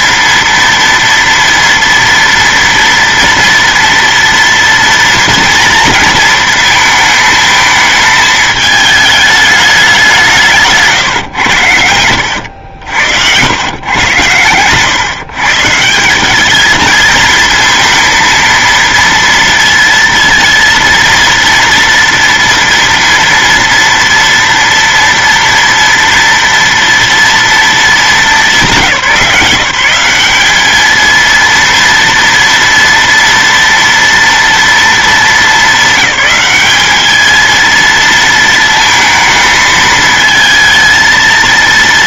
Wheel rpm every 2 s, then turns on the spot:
230, 230, 230, 220, 220, 150, 90, 110, 210, 230, 230, 230, 230, 230, 190, 210, 230, 230, 200, 220, 230.
10-12